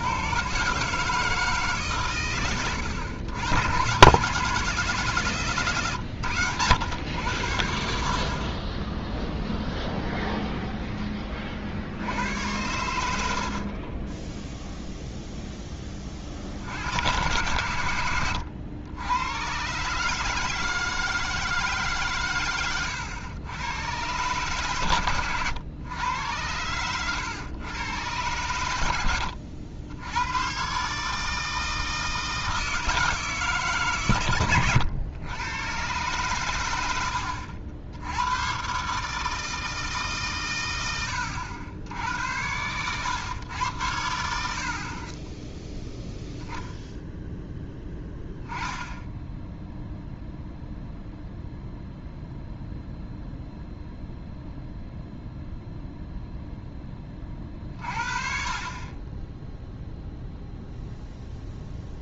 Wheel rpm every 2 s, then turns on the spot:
130, 100, 160, 100, 40, 0, 100, 0, 60, 90, 160, 120, 130, 110, 110, 120, 160, 100, 100, 120, 110, 90, 80, 0, 0, 0, 0, 0, 0, 30, 0.
8-10